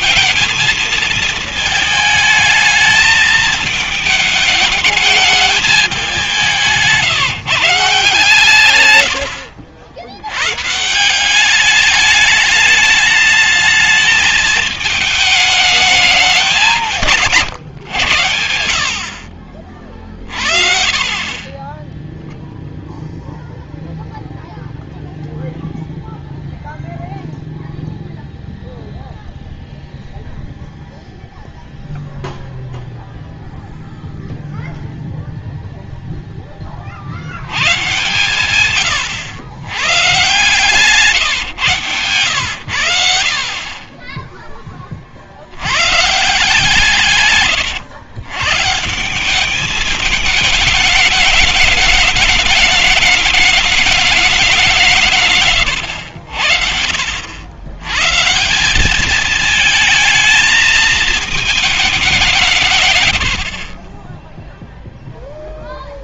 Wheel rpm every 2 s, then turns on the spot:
220, 220, 210, 170, 130, 160, 210, 210, 180, 80, 30, 0, 0, 0, 0, 0, 0, 0, 30, 110, 140, 80, 20, 160, 150, 210, 210, 180, 70, 190, 220, 150, 0.
8-10 20-22 40-42